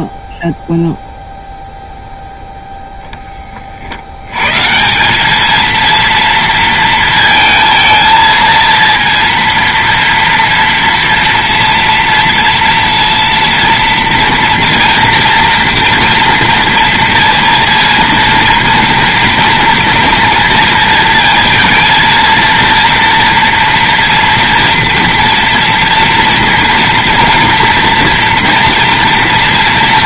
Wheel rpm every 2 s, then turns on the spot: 0, 0, 150, 230, 230, 230, 230, 230, 230, 230, 230, 230, 230, 240, 230.
none